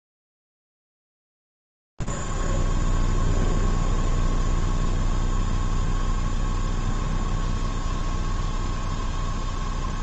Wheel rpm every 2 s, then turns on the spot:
0, 0, 0, 0, 0.
none